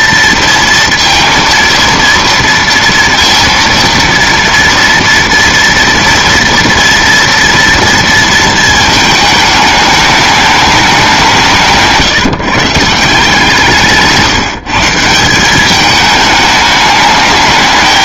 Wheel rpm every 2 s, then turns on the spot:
230, 230, 230, 230, 220, 210, 160, 160, 210.
none